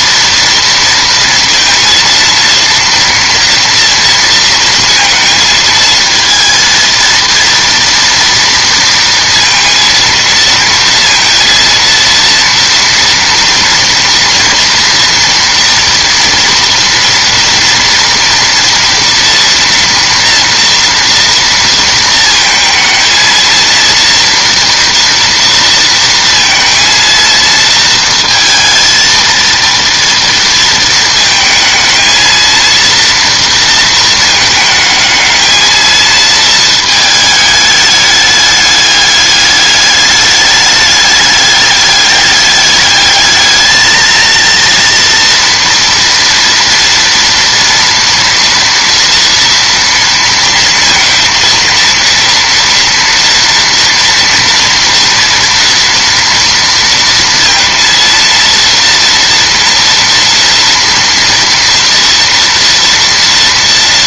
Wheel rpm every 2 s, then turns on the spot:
230, 230, 230, 230, 230, 230, 230, 240, 240, 230, 230, 220, 230, 230, 230, 230, 230, 220, 220, 210, 210, 210, 230, 230, 230, 230, 230, 230, 230, 230, 230, 240.
none